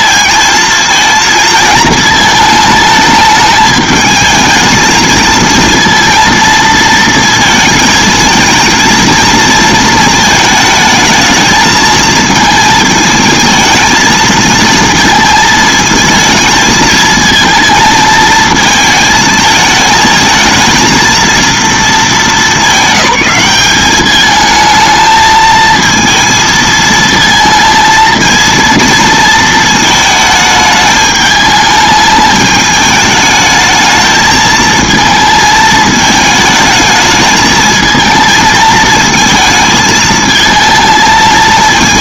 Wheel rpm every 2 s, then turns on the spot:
230, 220, 230, 230, 230, 220, 220, 230, 220, 220, 220, 210, 220, 220, 230, 210, 210, 220, 220, 220, 230.
none